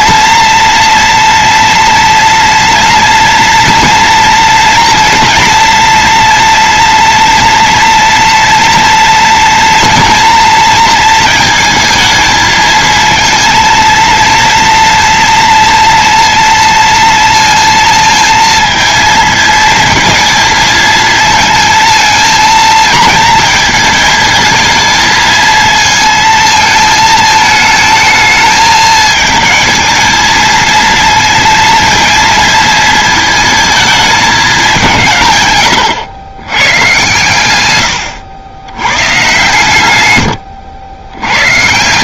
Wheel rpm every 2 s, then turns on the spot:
240, 230, 230, 230, 230, 230, 220, 230, 230, 230, 230, 220, 220, 230, 220, 230, 230, 190, 120, 110, 90.
none